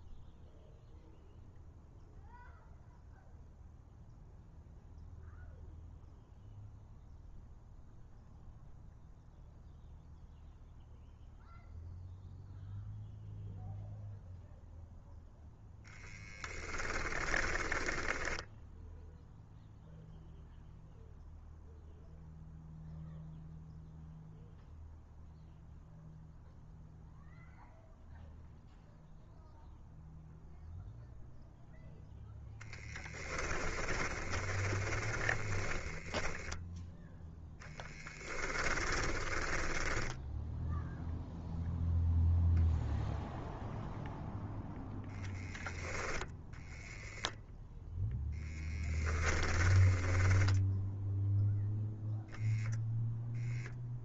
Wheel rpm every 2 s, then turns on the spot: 0, 0, 0, 0, 0, 0, 0, 0, 10, 0, 0, 0, 0, 0, 0, 0, 10, 20, 10, 20, 0, 0, 0, 0, 10, 0, 0.
16-18 34-36 38-40 48-50